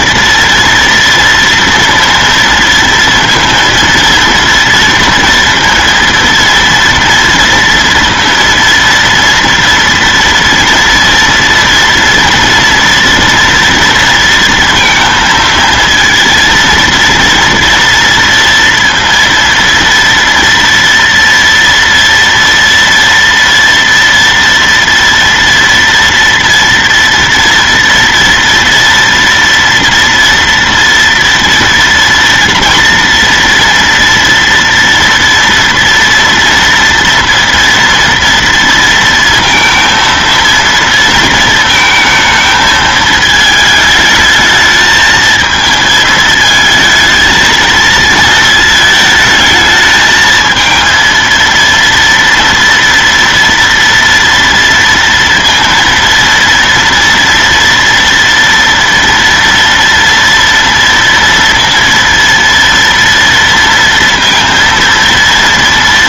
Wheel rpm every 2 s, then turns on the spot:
230, 230, 230, 230, 230, 240, 230, 230, 230, 230, 230, 230, 230, 230, 240, 230, 230, 230, 230, 230, 230, 220, 220, 220, 220, 220, 230, 230, 230, 230, 230, 230, 230.
none